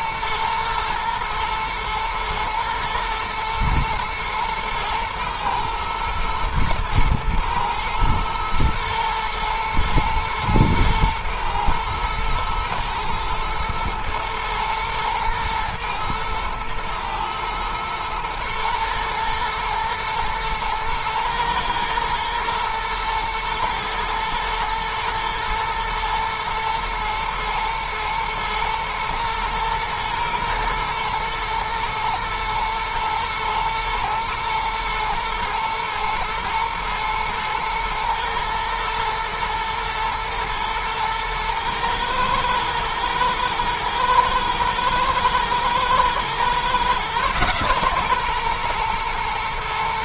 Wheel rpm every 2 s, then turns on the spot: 110, 110, 120, 110, 110, 110, 110, 110, 120, 120, 120, 110, 120, 110, 110, 120, 110, 110, 110, 120, 110, 110, 110, 120, 120.
none